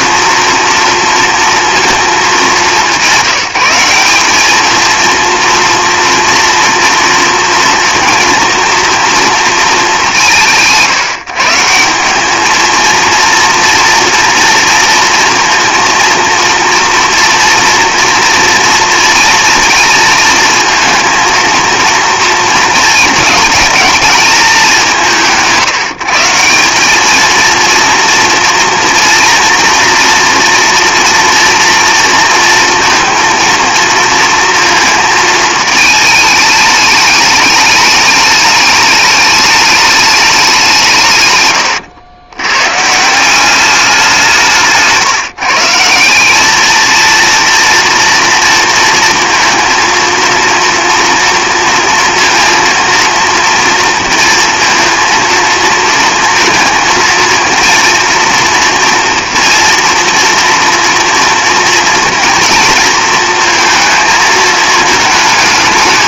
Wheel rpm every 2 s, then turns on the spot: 230, 210, 210, 230, 230, 170, 220, 230, 230, 230, 230, 230, 200, 170, 230, 230, 230, 230, 210, 210, 190, 110, 170, 210, 230, 230, 230, 230, 220, 230, 230, 230, 220.
none